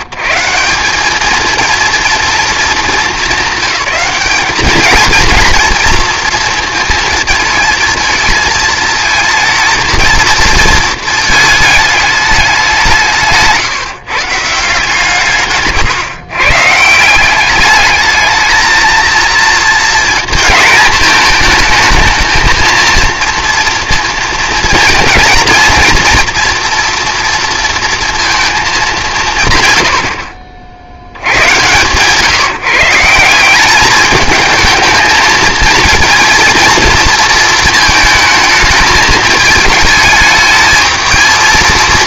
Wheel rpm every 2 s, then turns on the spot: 170, 220, 220, 230, 220, 230, 190, 150, 140, 220, 230, 220, 230, 230, 200, 60, 150, 220, 230, 210, 220.
none